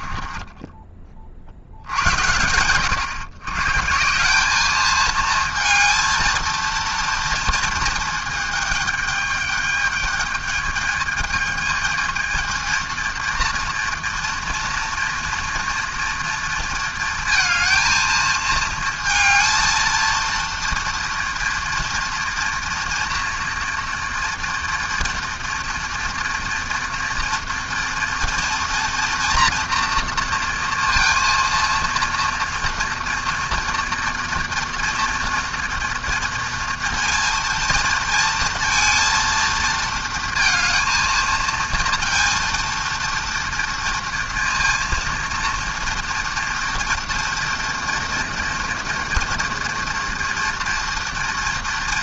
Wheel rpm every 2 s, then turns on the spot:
20, 120, 220, 230, 210, 210, 230, 230, 230, 220, 230, 240, 240, 230, 230, 230, 240, 230, 230, 230, 220, 230, 230, 230, 230, 230.
none